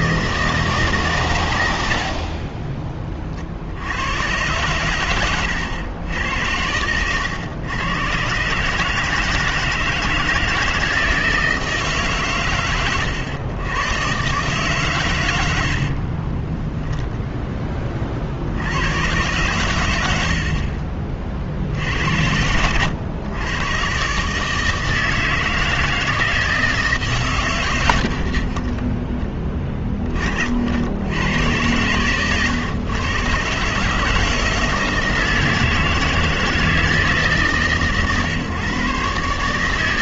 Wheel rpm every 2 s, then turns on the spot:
160, 30, 120, 90, 140, 160, 120, 130, 10, 70, 60, 90, 150, 160, 50, 60, 120, 160, 160, 130.
2-4 16-18 22-24